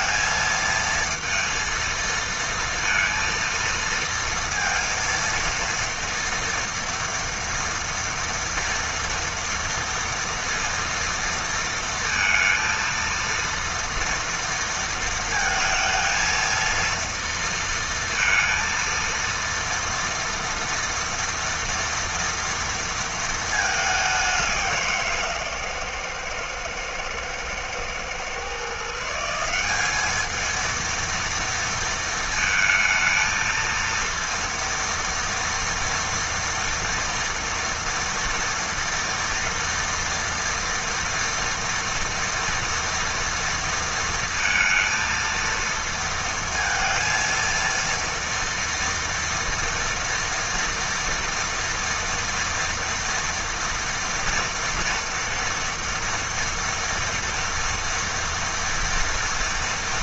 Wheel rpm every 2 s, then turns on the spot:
230, 230, 230, 230, 230, 230, 230, 230, 230, 230, 230, 230, 170, 110, 150, 230, 220, 230, 240, 230, 230, 230, 230, 230, 230, 230, 240, 230, 230, 230.
none